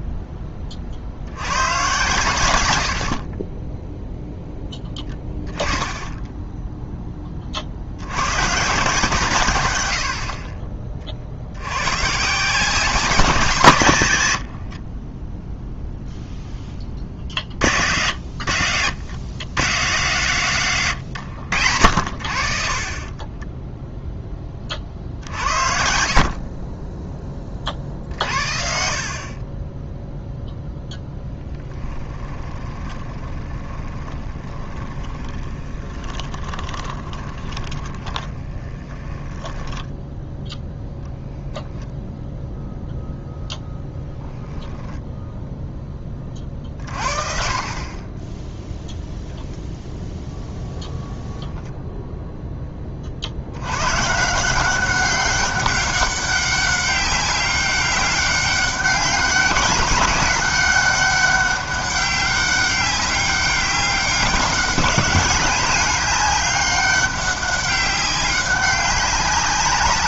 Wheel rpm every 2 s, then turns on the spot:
30, 100, 10, 10, 130, 40, 180, 60, 10, 90, 120, 30, 30, 30, 50, 0, 20, 20, 20, 20, 0, 0, 0, 40, 0, 0, 20, 180, 200, 200, 200, 200, 190, 200, 200.
2-8 14-16 28-30 32-40